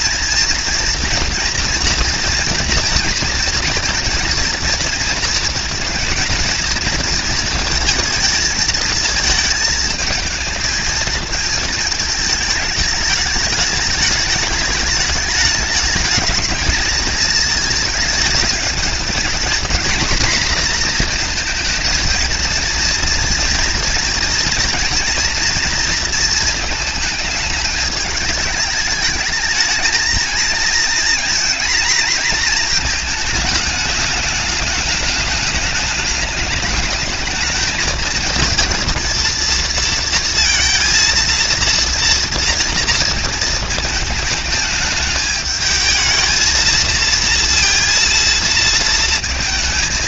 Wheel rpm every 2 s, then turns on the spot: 230, 230, 230, 230, 220, 230, 210, 210, 220, 220, 230, 230, 230, 220, 210, 220, 230, 210, 220, 230, 230, 230, 210, 230, 220.
none